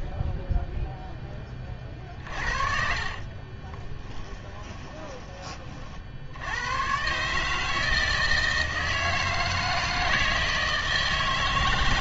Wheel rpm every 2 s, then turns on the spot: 0, 40, 20, 90, 160, 160.
2-6